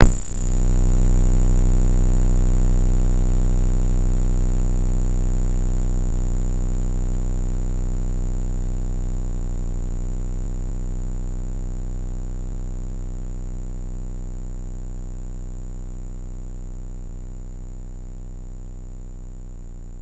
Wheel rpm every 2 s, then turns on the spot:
0, 10, 20, 50, 50, 120, 110, 160, 160, 160.
8-10